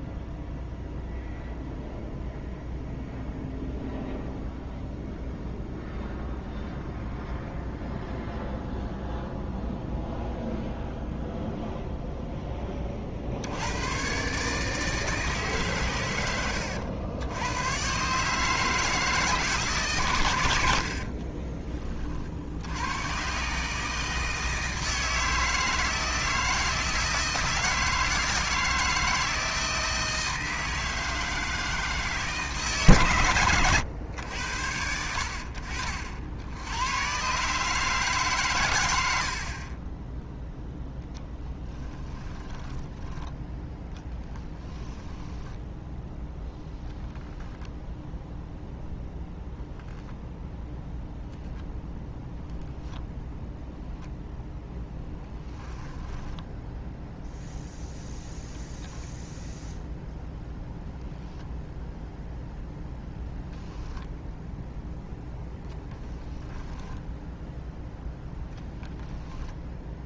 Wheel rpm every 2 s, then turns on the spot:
0, 0, 0, 0, 0, 0, 30, 150, 90, 150, 70, 100, 160, 160, 160, 160, 140, 80, 100, 120, 0, 10, 10, 0, 0, 0, 0, 10, 0, 0, 0, 0, 0, 10, 10.
20-22 42-46 54-56 66-68